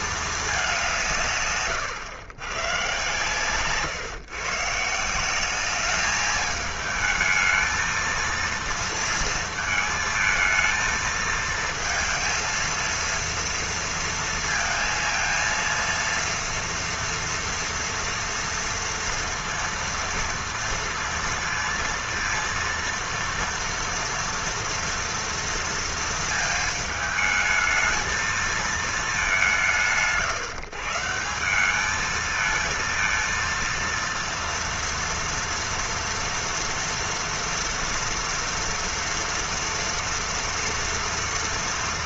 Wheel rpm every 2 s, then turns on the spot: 220, 100, 140, 210, 230, 220, 230, 230, 230, 230, 230, 230, 230, 230, 220, 130, 220, 230, 230, 230, 230.
none